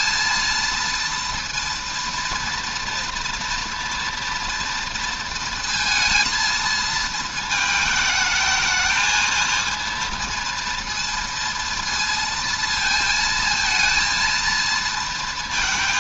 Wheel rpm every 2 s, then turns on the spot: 230, 230, 230, 220, 220, 230, 230, 230.
none